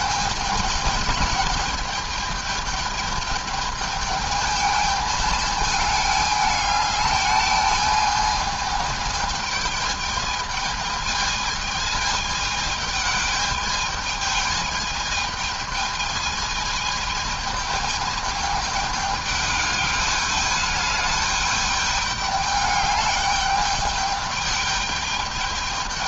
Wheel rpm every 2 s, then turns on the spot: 210, 220, 210, 210, 210, 210, 220, 210, 220, 210, 210, 210, 210.
none